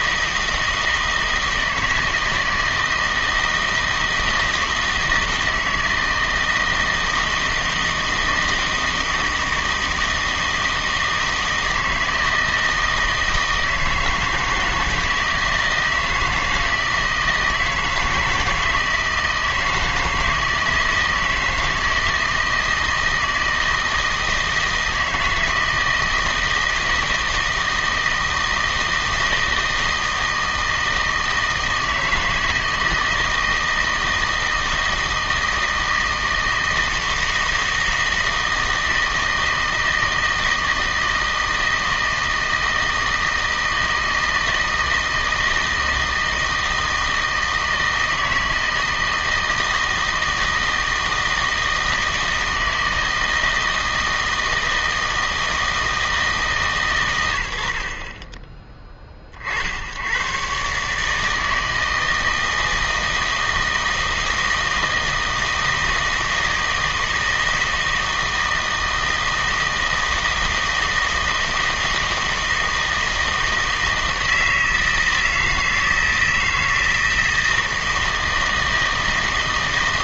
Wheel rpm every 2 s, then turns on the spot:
160, 160, 160, 160, 160, 160, 160, 160, 160, 160, 160, 160, 160, 160, 160, 160, 160, 160, 160, 160, 160, 160, 160, 160, 160, 160, 160, 160, 130, 20, 140, 160, 160, 160, 160, 160, 160, 160, 160, 160.
none